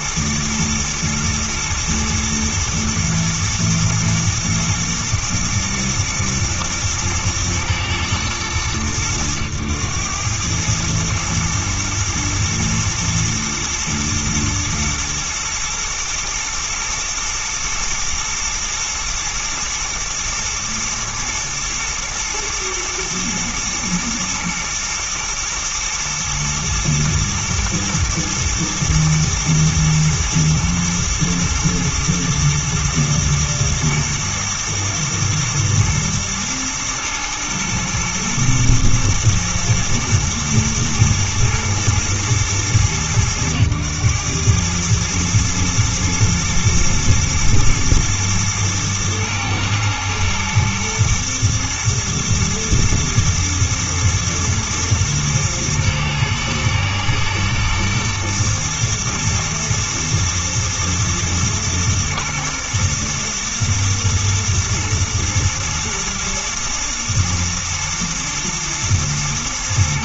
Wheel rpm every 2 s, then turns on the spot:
120, 120, 110, 110, 100, 100, 120, 110, 110, 120, 110, 120, 120, 110, 120, 120, 110, 110, 110, 110, 110, 110, 110, 120, 110, 120, 120, 110, 110, 120, 110, 110, 110, 120, 120.
none